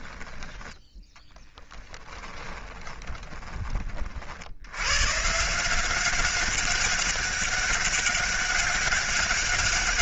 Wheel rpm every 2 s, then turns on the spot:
10, 10, 110, 200, 200.
2-4